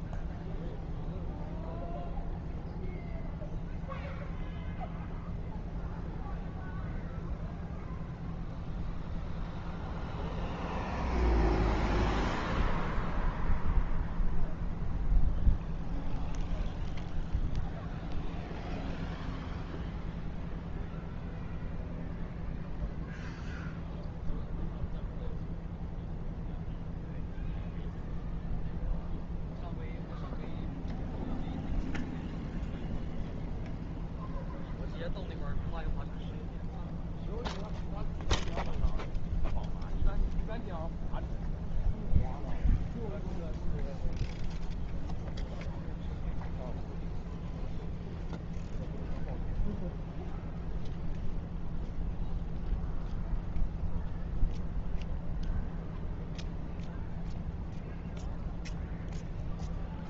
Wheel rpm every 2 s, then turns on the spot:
0, 0, 0, 0, 0, 0, 0, 0, 0, 0, 0, 0, 0, 0, 0, 0, 0, 0, 0, 0, 0, 0, 0, 0, 0, 0, 0, 0, 0, 0.
none